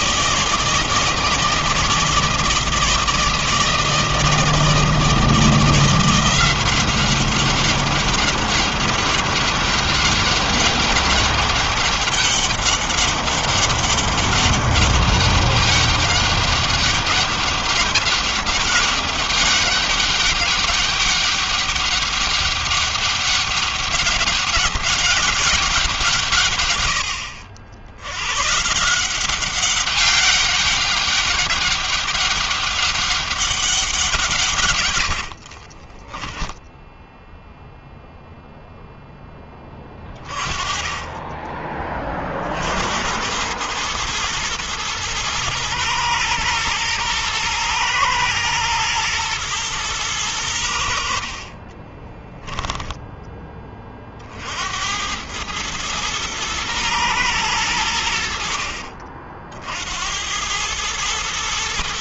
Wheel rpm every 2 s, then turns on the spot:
160, 160, 160, 180, 200, 200, 200, 200, 200, 200, 200, 200, 200, 150, 110, 200, 200, 150, 10, 0, 30, 40, 110, 110, 120, 100, 20, 50, 110, 70, 90.
36-38 52-54 58-60